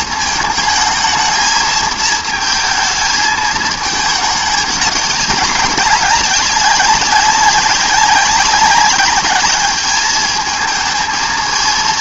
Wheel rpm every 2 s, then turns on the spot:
220, 220, 200, 200, 190, 220.
none